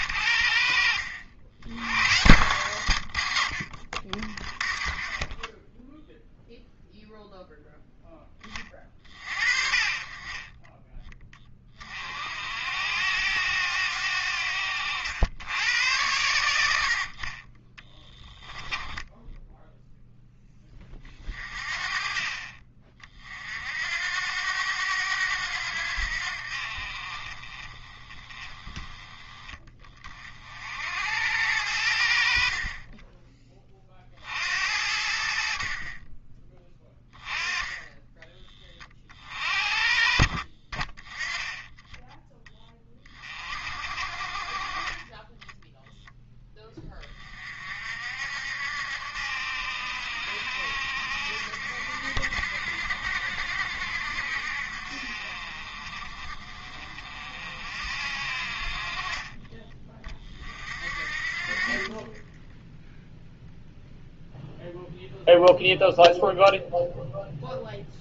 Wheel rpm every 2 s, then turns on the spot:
60, 120, 20, 0, 30, 20, 80, 80, 60, 10, 20, 40, 90, 60, 20, 70, 30, 70, 10, 30, 40, 20, 30, 20, 70, 70, 70, 60, 50, 50, 50, 0, 0, 0.
4-6 14-16